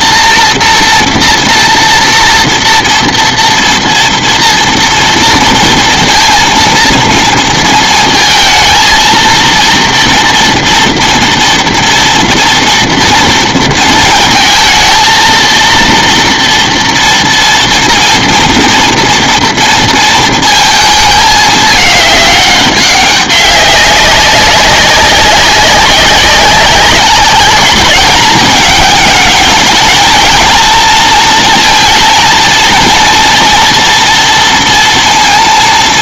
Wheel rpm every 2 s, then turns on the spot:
240, 230, 230, 230, 220, 240, 230, 230, 230, 230, 230, 200, 190, 190, 220, 230, 230, 230.
none